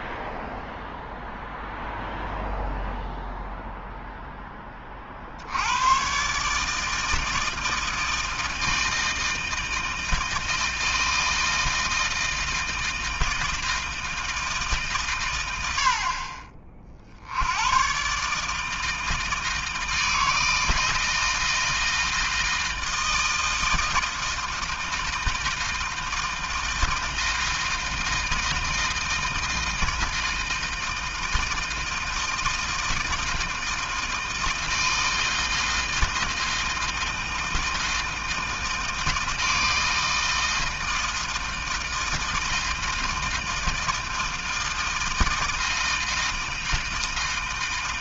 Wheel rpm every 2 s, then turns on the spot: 0, 0, 40, 160, 160, 160, 160, 130, 60, 160, 160, 160, 160, 160, 160, 160, 160, 160, 160, 160, 160, 160, 160, 160.
none